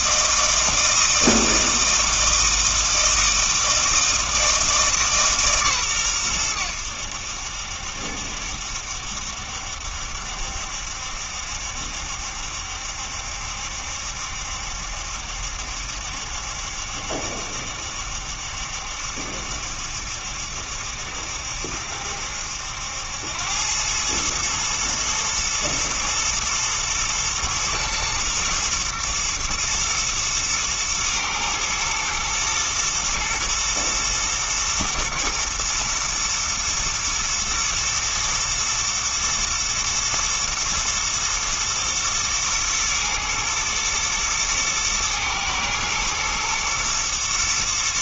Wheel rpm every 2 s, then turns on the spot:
160, 160, 160, 100, 70, 70, 70, 70, 70, 70, 70, 80, 110, 110, 120, 120, 110, 110, 110, 110, 110, 110, 110, 110.
none